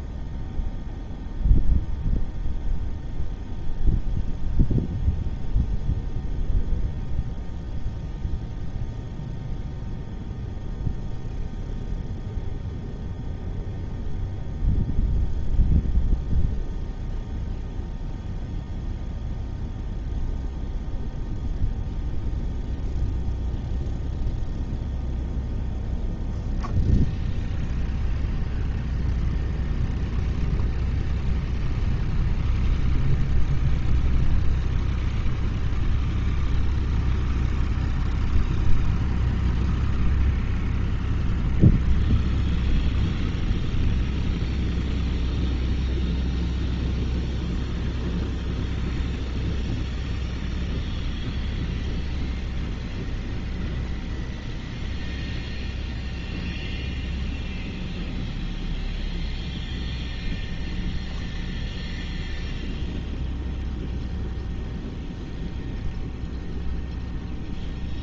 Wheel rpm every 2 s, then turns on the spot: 0, 0, 0, 0, 0, 0, 0, 0, 0, 0, 0, 0, 0, 0, 0, 0, 0, 0, 0, 0, 0, 0, 0, 0, 0, 0, 0, 0, 0, 0, 0, 0, 0, 0.
none